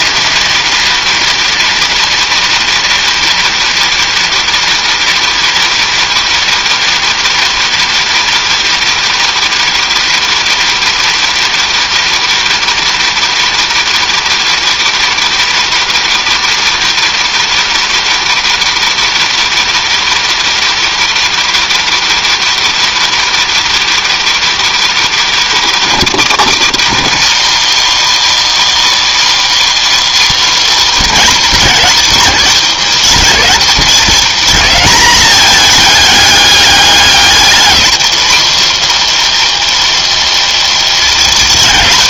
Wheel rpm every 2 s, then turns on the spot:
230, 230, 230, 230, 220, 230, 220, 220, 220, 220, 220, 220, 220, 210, 300, 270, 190, 200, 210, 230, 210.
none